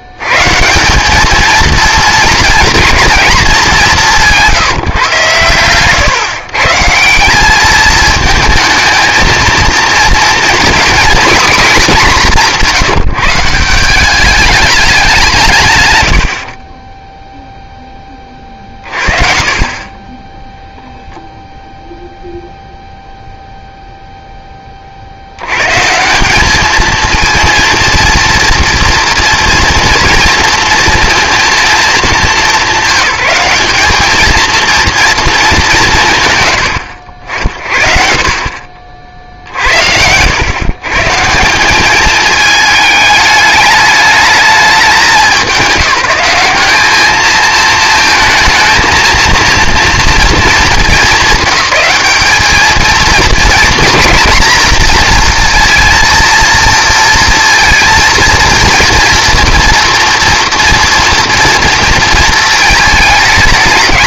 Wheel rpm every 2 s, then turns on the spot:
150, 230, 160, 150, 220, 240, 210, 210, 70, 40, 0, 0, 30, 210, 230, 230, 200, 230, 100, 50, 130, 220, 200, 200, 220, 220, 220, 230, 230, 230, 230, 220.
none